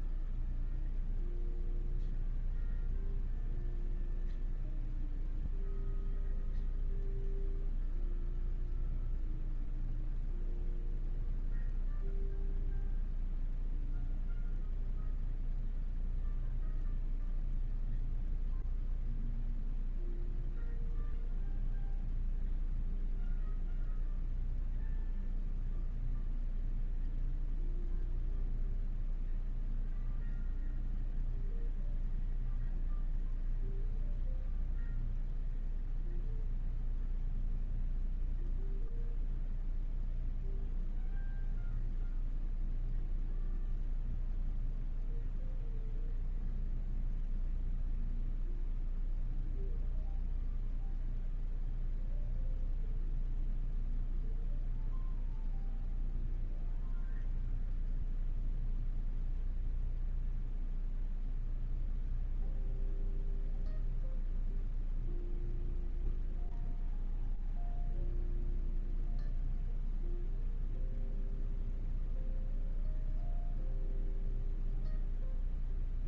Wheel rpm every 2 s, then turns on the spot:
0, 0, 0, 0, 0, 0, 0, 0, 0, 0, 0, 0, 0, 0, 0, 0, 0, 0, 0, 0, 0, 0, 0, 0, 0, 0, 0, 0, 0, 0, 0, 0, 0, 0, 0, 0, 0, 0.
none